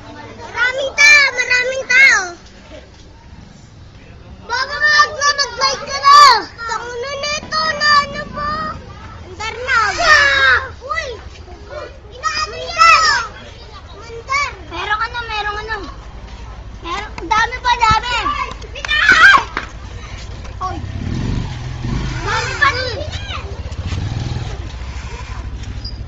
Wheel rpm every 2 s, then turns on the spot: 0, 0, 0, 0, 0, 0, 0, 0, 0, 0, 0, 0, 0.
none